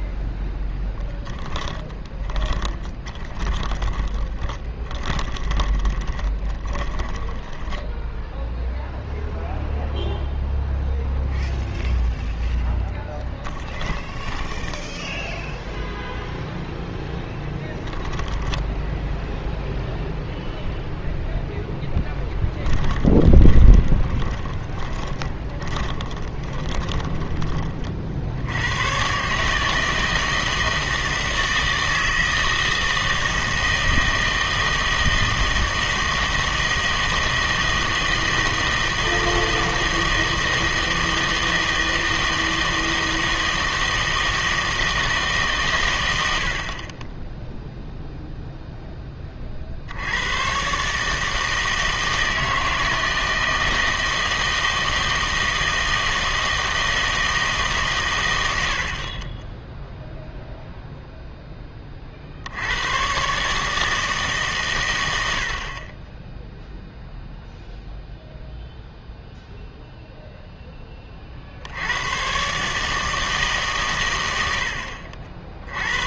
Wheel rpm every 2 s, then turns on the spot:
10, 10, 20, 20, 0, 0, 10, 10, 0, 10, 0, 10, 10, 20, 90, 160, 160, 160, 160, 160, 160, 160, 160, 60, 0, 130, 160, 160, 160, 80, 0, 80, 130, 0, 0, 10, 140, 80.
0-8 12-16 22-28